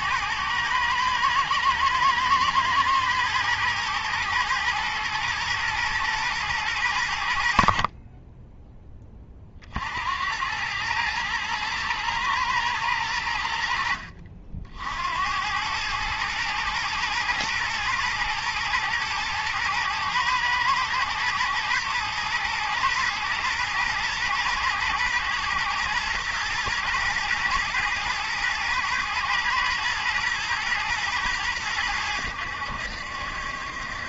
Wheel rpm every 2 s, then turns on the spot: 110, 110, 120, 100, 20, 110, 110, 70, 110, 110, 110, 120, 120, 110, 120, 120, 80.
none